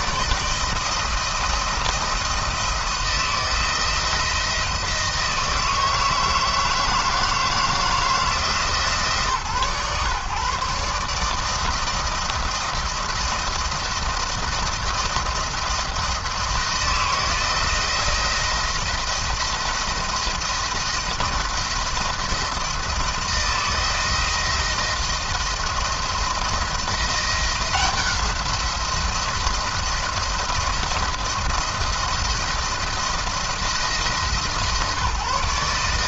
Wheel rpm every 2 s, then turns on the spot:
160, 170, 160, 160, 150, 150, 170, 170, 160, 170, 170, 170, 170, 170, 170, 170, 170, 150.
none